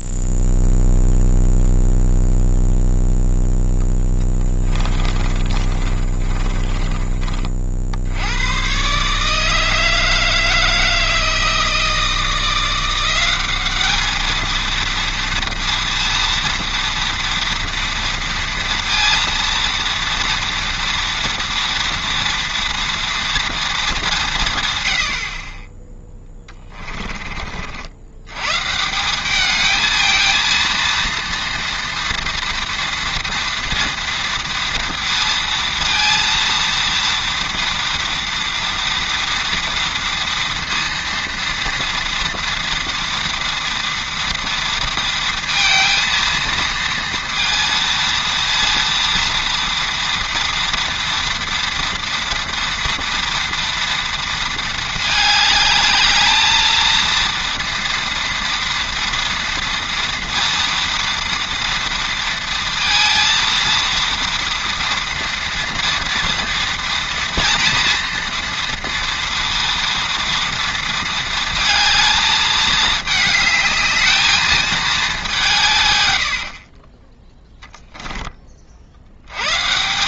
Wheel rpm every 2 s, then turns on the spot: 0, 0, 20, 20, 120, 160, 170, 230, 230, 230, 240, 230, 140, 20, 140, 230, 230, 230, 230, 230, 230, 230, 230, 230, 230, 230, 240, 220, 220, 230, 230, 230, 230, 230, 230, 230, 220, 220, 40, 40.
4-8 26-28 76-78